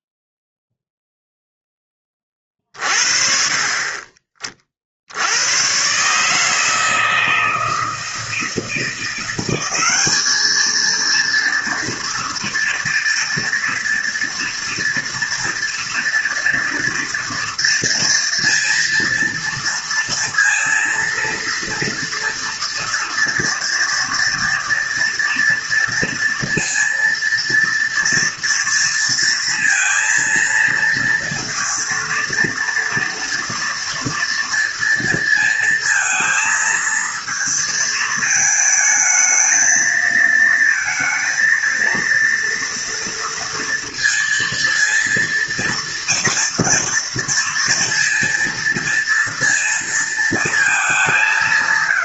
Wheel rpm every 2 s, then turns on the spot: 0, 40, 40, 160, 160, 220, 230, 230, 240, 230, 230, 230, 230, 230, 230, 230, 230, 230, 230, 220, 230, 230, 230, 230, 230, 220.
none